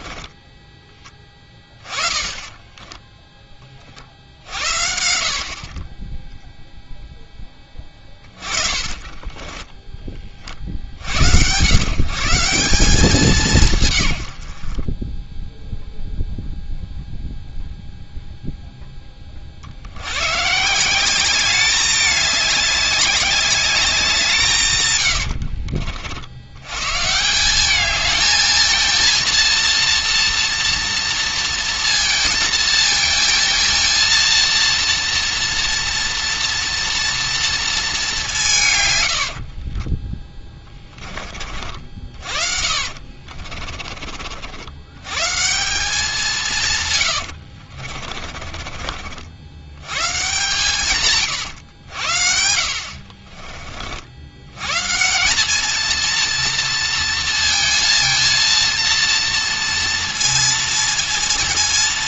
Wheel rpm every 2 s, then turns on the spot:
10, 20, 70, 0, 30, 50, 180, 50, 0, 0, 150, 200, 160, 110, 220, 230, 220, 230, 230, 150, 10, 50, 70, 140, 40, 140, 70, 120, 230, 230, 230.
2-4 8-10 42-44 48-50